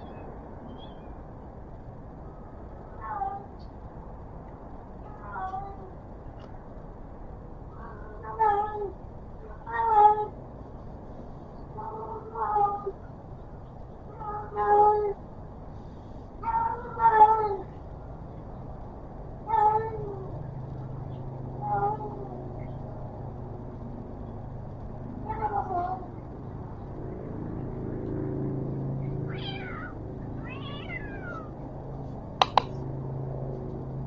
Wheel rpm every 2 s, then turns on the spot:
0, 0, 0, 0, 0, 0, 0, 0, 0, 0, 0, 0, 0, 0, 0, 0, 0.
none